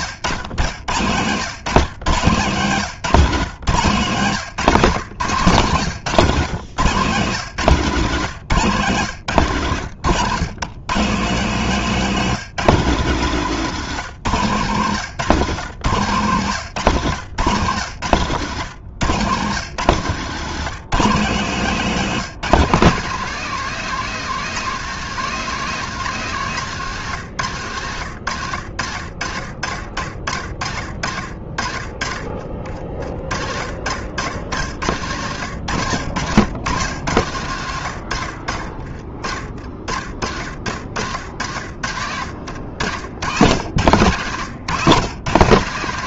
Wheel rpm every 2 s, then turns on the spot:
120, 160, 170, 140, 150, 130, 170, 140, 130, 120, 160, 180, 200, 180, 110, 60, 50, 100, 110, 50, 70, 80, 140.
38-40